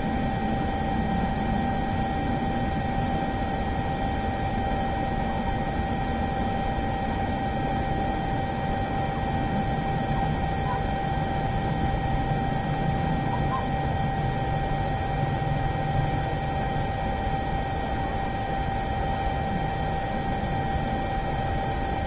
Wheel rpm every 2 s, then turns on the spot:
0, 0, 0, 0, 0, 0, 0, 0, 0, 0, 0.
none